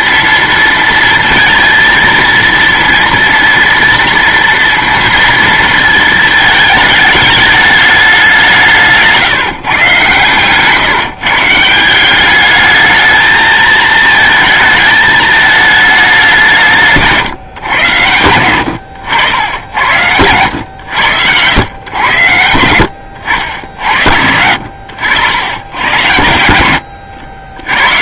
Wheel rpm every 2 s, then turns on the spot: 230, 230, 230, 220, 190, 130, 200, 220, 190, 110, 100, 90, 70, 80.
none